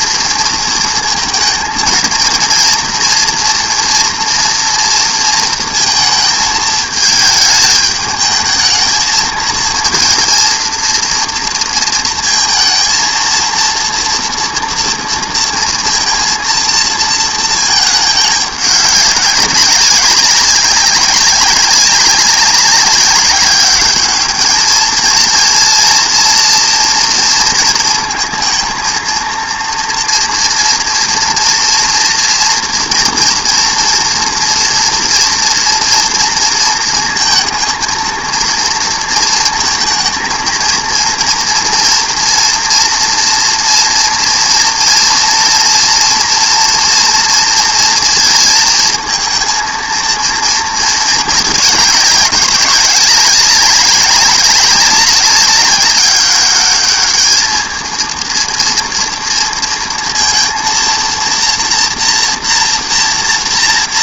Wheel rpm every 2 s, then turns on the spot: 230, 230, 230, 220, 220, 230, 230, 230, 230, 200, 190, 190, 220, 240, 230, 230, 230, 230, 230, 230, 230, 240, 230, 230, 230, 220, 200, 200, 200, 230, 230, 230.
none